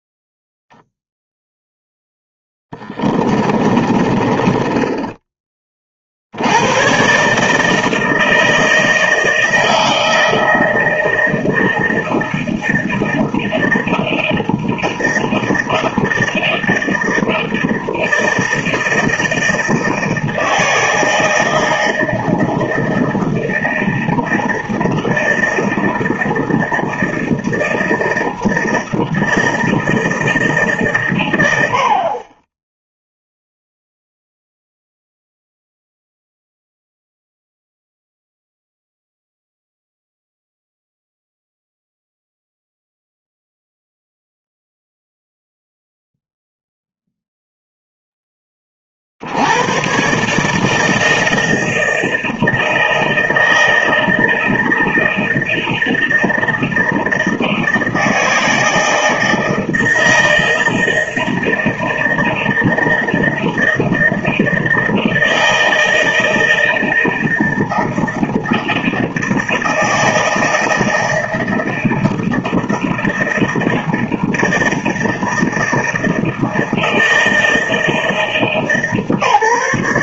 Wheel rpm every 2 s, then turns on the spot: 0, 10, 20, 110, 160, 160, 160, 160, 160, 160, 160, 160, 160, 160, 160, 140, 10, 0, 0, 0, 0, 0, 0, 0, 30, 160, 160, 160, 160, 160, 160, 160, 160, 160, 160, 160, 160, 160, 160, 150.
2-6